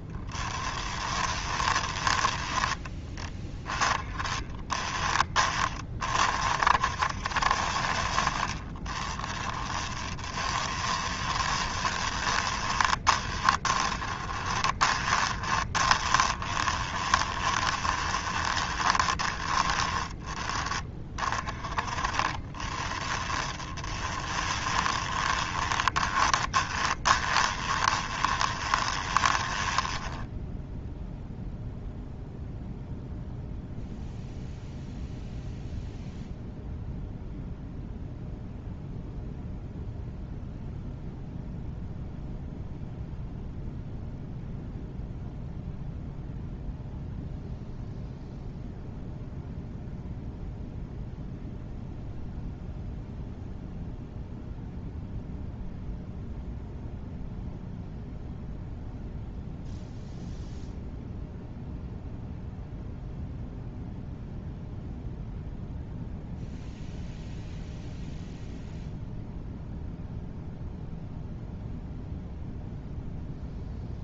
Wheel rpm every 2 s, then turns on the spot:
10, 10, 20, 60, 40, 20, 20, 20, 20, 20, 20, 20, 20, 20, 20, 0, 0, 0, 0, 0, 0, 0, 0, 0, 0, 0, 0, 0, 0, 0, 0, 0, 0, 0, 0, 0, 0.
0-2 8-20 22-30